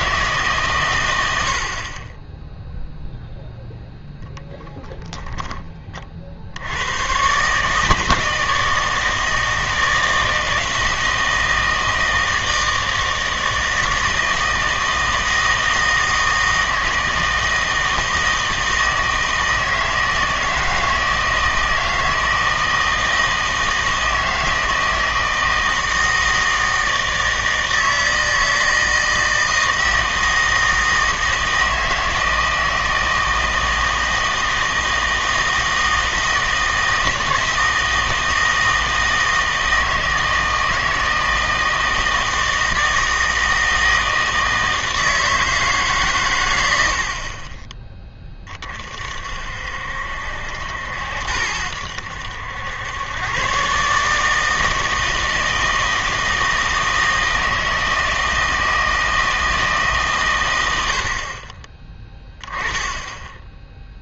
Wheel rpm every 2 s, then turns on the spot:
140, 0, 0, 80, 160, 160, 160, 160, 160, 160, 160, 160, 160, 160, 160, 160, 160, 160, 160, 160, 160, 160, 160, 100, 30, 70, 90, 160, 160, 160, 110, 10.
none